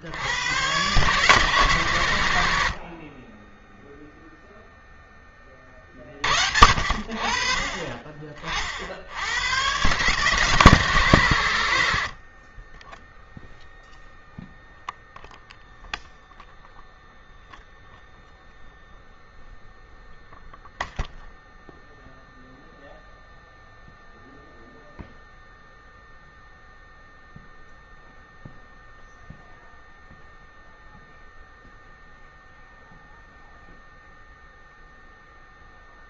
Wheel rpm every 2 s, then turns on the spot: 120, 40, 10, 50, 70, 130, 10, 0, 0, 0, 0, 0, 0, 0, 0, 0, 0, 0.
none